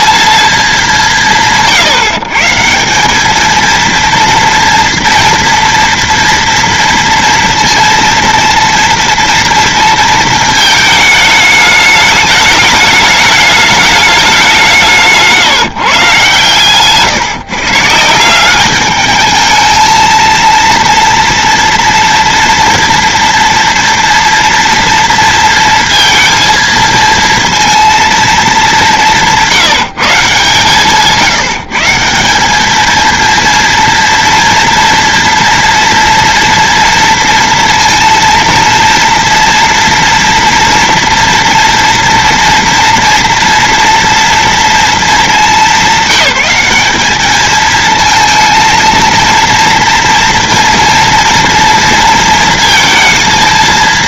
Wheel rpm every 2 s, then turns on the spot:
220, 160, 230, 230, 230, 220, 210, 170, 130, 190, 230, 230, 230, 220, 220, 150, 210, 240, 230, 230, 230, 230, 230, 200, 230, 240, 230.
none